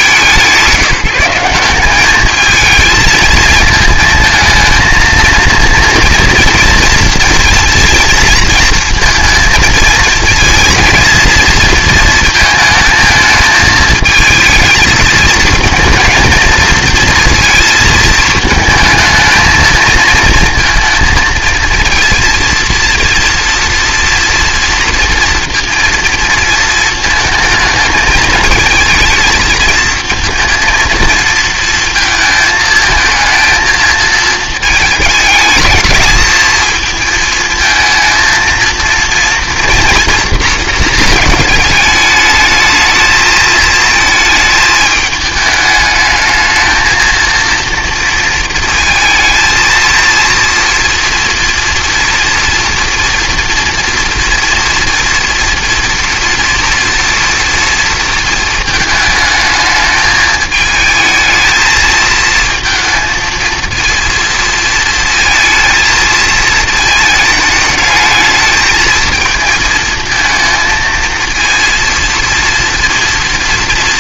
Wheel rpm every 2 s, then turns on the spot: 180, 220, 220, 230, 220, 220, 220, 220, 230, 220, 230, 230, 240, 230, 220, 230, 220, 220, 220, 230, 230, 220, 220, 220, 220, 230, 230, 240, 230, 220, 220, 220, 230, 220, 220, 230, 230.
none